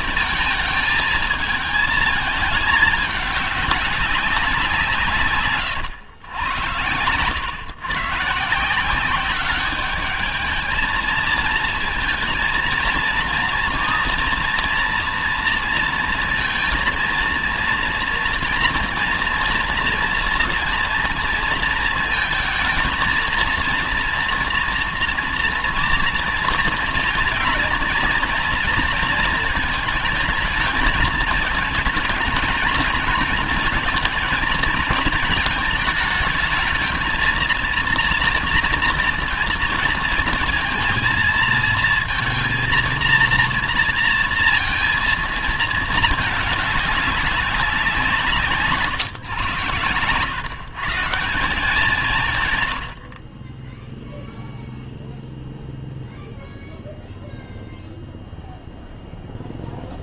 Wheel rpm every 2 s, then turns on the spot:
220, 220, 190, 110, 160, 220, 220, 230, 230, 230, 230, 220, 230, 230, 230, 220, 220, 230, 220, 230, 230, 230, 230, 210, 160, 120, 130, 0, 0, 0.
none